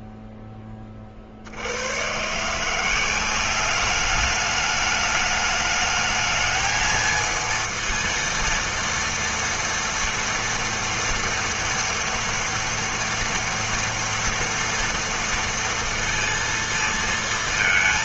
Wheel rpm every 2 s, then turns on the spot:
0, 150, 210, 220, 230, 230, 230, 230, 230.
none